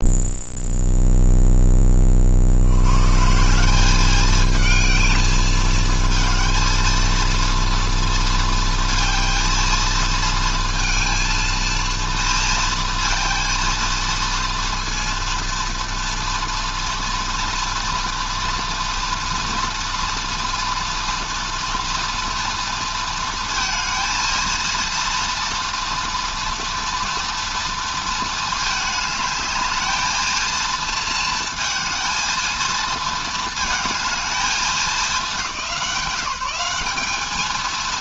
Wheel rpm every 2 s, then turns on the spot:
0, 100, 220, 230, 230, 230, 230, 230, 230, 230, 230, 230, 230, 230, 220, 230, 230, 200, 200.
none